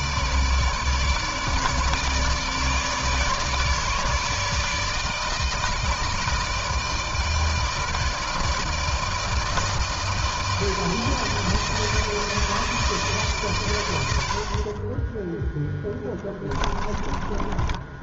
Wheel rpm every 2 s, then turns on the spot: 150, 150, 150, 160, 160, 160, 150, 30, 30.
16-18